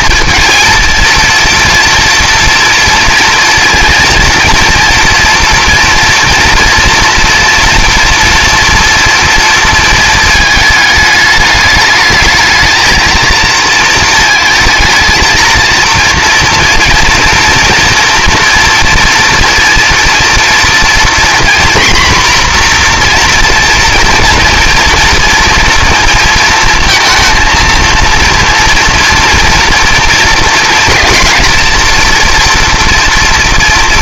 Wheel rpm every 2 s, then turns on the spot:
230, 230, 240, 240, 230, 220, 220, 220, 230, 230, 240, 250, 240, 230, 230, 230, 230.
none